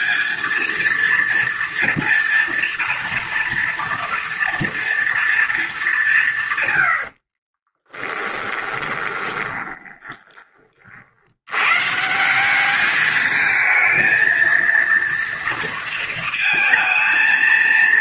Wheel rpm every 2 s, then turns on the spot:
220, 240, 230, 120, 20, 30, 200, 230, 220.
8-10